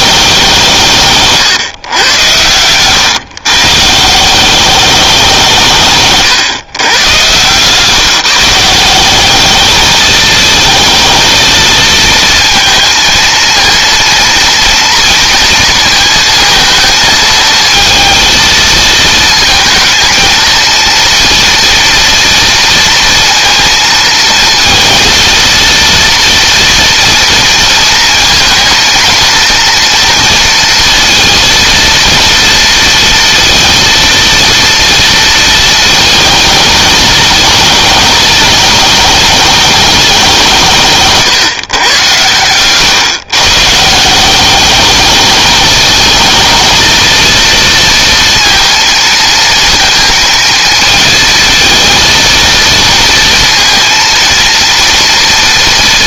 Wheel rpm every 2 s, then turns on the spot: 160, 120, 200, 110, 170, 220, 230, 230, 220, 220, 230, 230, 230, 230, 230, 230, 230, 230, 220, 220, 160, 120, 210, 230, 230, 230, 230, 230.
40-42